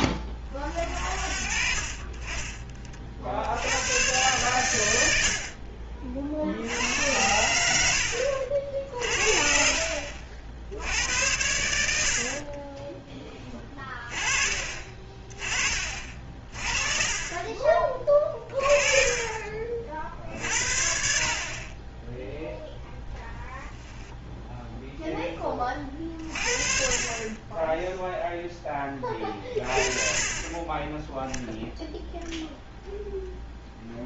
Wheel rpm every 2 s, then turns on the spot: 20, 30, 110, 70, 60, 70, 40, 30, 40, 30, 50, 0, 0, 40, 10, 30, 0.
12-14